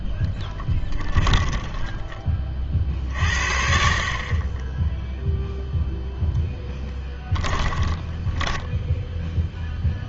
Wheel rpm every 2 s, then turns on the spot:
10, 30, 20, 10, 10.
0-2 8-10